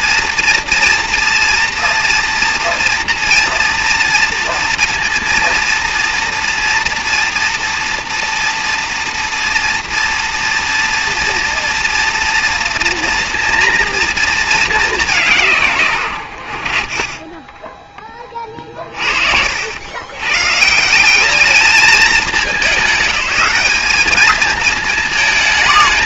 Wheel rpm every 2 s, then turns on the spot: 230, 230, 230, 230, 230, 230, 240, 220, 30, 50, 150, 180, 220.
18-20